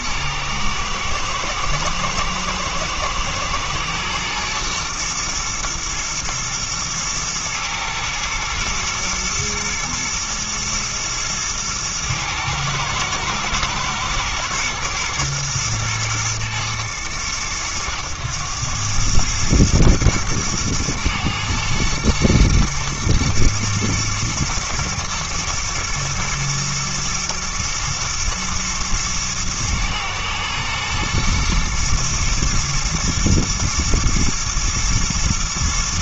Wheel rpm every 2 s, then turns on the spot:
110, 110, 120, 110, 110, 110, 110, 120, 110, 100, 110, 110, 120, 120, 110, 110, 120, 110.
none